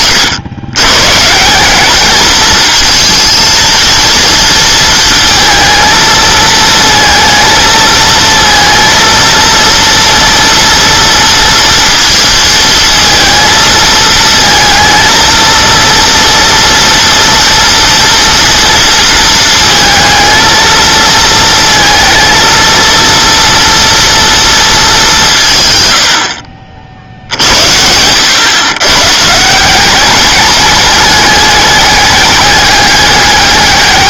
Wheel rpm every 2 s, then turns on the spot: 120, 220, 230, 220, 230, 230, 230, 230, 230, 230, 230, 230, 220, 60, 120, 210, 210.
none